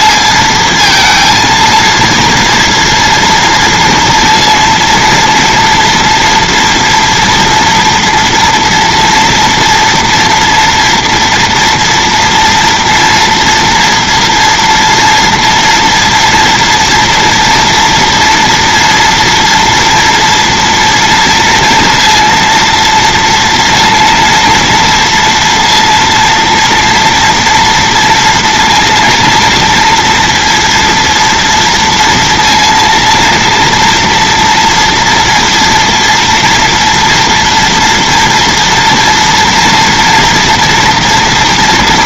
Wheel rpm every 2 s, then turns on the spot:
230, 230, 230, 240, 230, 230, 230, 230, 240, 230, 230, 230, 230, 240, 230, 230, 230, 240, 230, 230, 230.
none